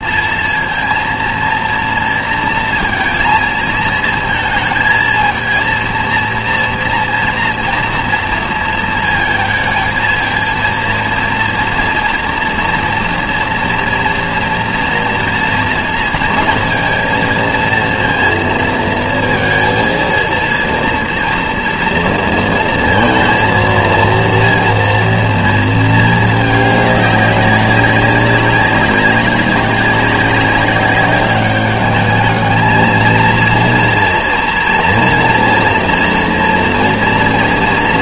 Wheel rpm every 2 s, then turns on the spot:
230, 230, 230, 230, 230, 230, 230, 230, 230, 230, 230, 230, 230, 210, 190, 200, 230, 230, 230.
none